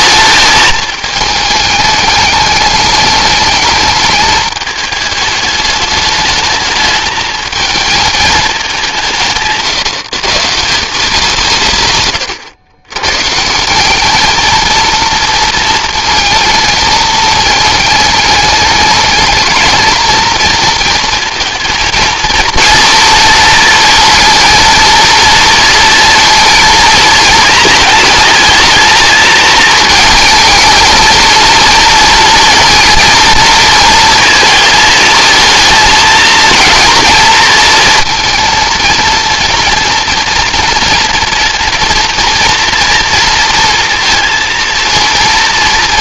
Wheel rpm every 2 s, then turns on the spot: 220, 210, 210, 210, 190, 180, 110, 230, 220, 210, 230, 230, 230, 230, 220, 220, 230, 220, 230, 230, 230, 230, 230.
none